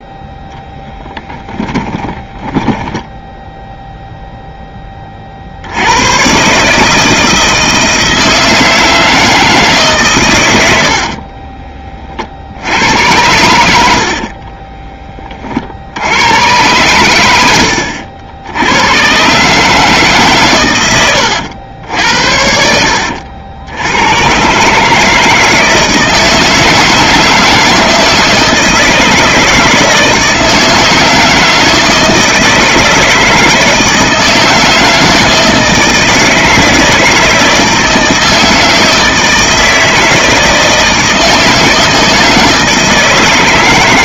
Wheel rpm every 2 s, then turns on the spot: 0, 20, 0, 120, 160, 130, 50, 40, 100, 70, 140, 70, 120, 160, 160, 160, 160, 160, 160, 160, 160, 160.
2-4 14-16